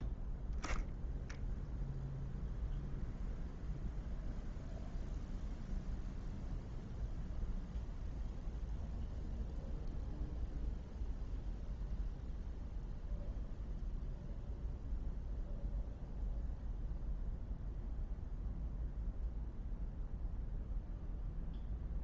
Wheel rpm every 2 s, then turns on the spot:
0, 0, 0, 0, 0, 0, 0, 0, 0, 0, 0.
none